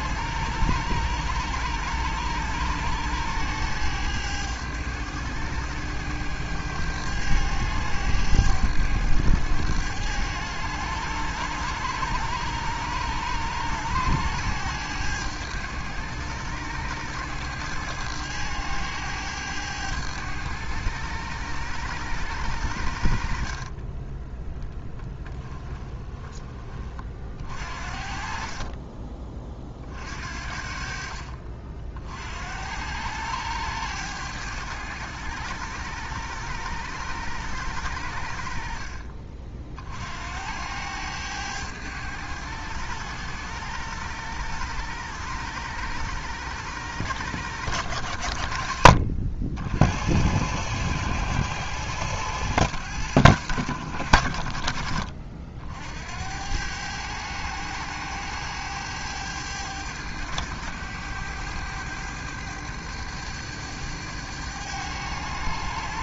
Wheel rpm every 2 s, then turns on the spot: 100, 100, 100, 100, 100, 100, 100, 100, 100, 100, 100, 70, 10, 40, 30, 50, 90, 100, 100, 50, 100, 100, 100, 100, 70, 110, 100, 50, 100, 100, 100, 100, 100.
24-26 28-30